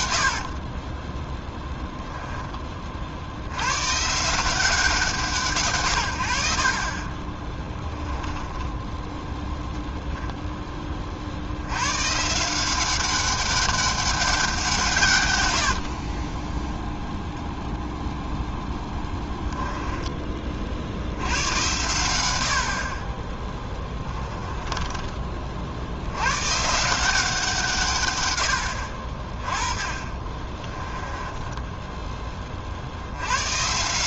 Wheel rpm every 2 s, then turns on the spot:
30, 30, 180, 40, 10, 20, 180, 170, 0, 10, 60, 40, 20, 160, 80, 20, 50.
0-2 18-20 24-26 30-32